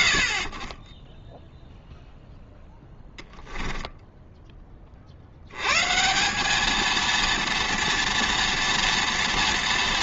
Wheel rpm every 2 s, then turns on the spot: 50, 10, 30, 220, 230.
2-4